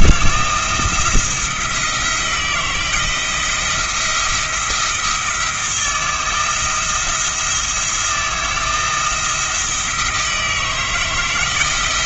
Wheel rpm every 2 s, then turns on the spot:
160, 170, 170, 170, 170, 160.
none